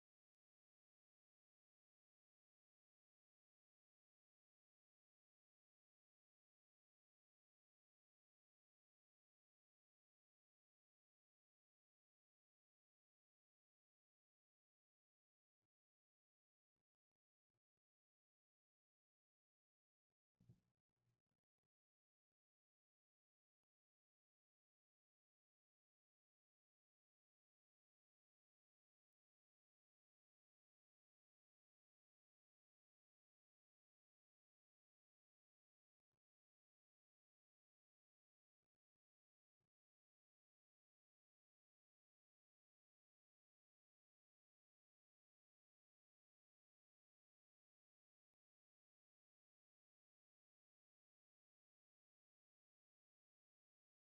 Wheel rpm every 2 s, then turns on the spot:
0, 0, 0, 0, 0, 0, 0, 0, 0, 0, 0, 0, 0, 0, 0, 0, 0, 0, 0, 0, 0, 0, 0, 0, 0, 0, 0.
none